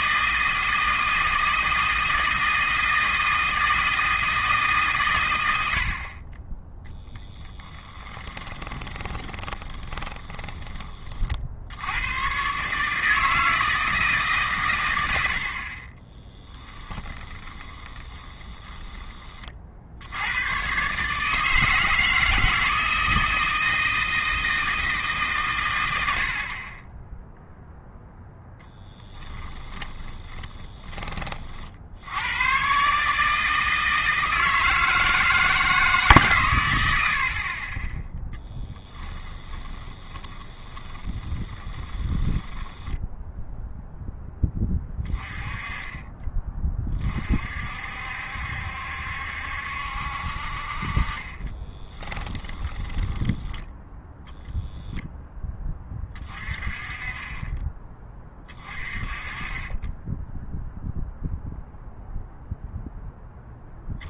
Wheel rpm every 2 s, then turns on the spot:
160, 160, 150, 20, 20, 30, 140, 110, 10, 20, 120, 160, 160, 30, 10, 20, 130, 160, 110, 10, 20, 10, 10, 30, 70, 50, 20, 0, 30, 30, 0, 0.
6-10 16-20 28-32 38-44 52-54